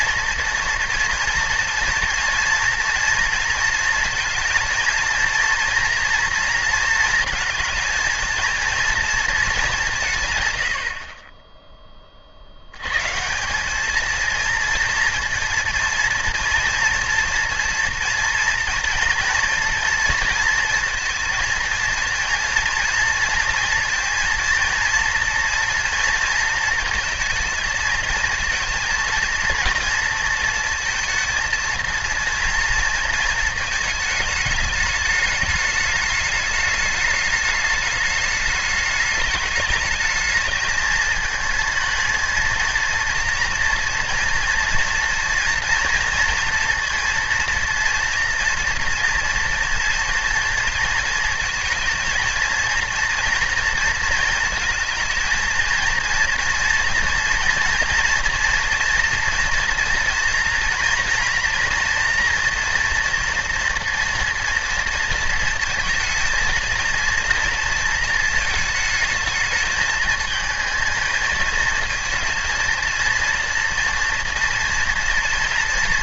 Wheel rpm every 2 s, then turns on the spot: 230, 230, 230, 230, 230, 70, 120, 230, 230, 230, 230, 240, 230, 230, 230, 230, 230, 210, 210, 210, 220, 230, 230, 230, 240, 230, 230, 220, 230, 230, 230, 230, 230, 230, 220, 220, 230, 230.
none